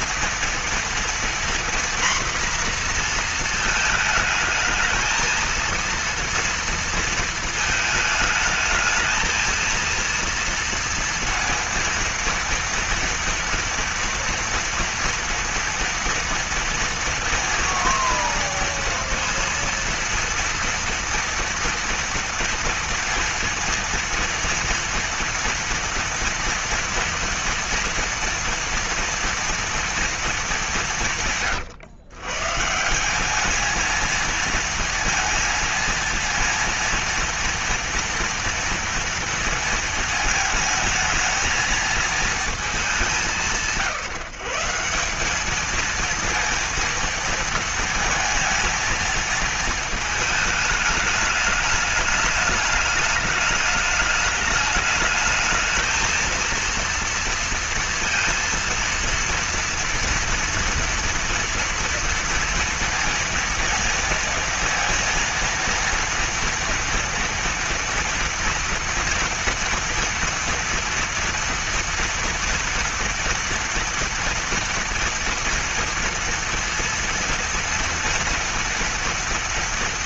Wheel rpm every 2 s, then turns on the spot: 230, 240, 220, 230, 220, 230, 230, 230, 230, 230, 230, 230, 230, 230, 230, 230, 120, 220, 230, 230, 220, 220, 180, 230, 230, 220, 220, 210, 220, 230, 230, 230, 230, 230, 230, 230, 230, 230, 230, 230.
none